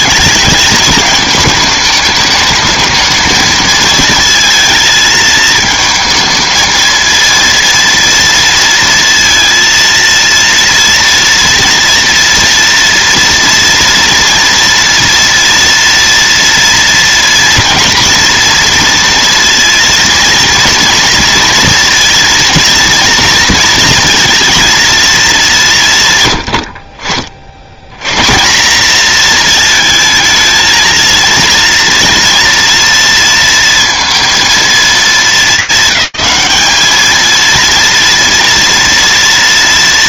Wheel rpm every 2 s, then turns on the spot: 220, 220, 220, 220, 230, 230, 230, 230, 230, 240, 230, 230, 230, 90, 190, 220, 230, 220, 200, 230.
none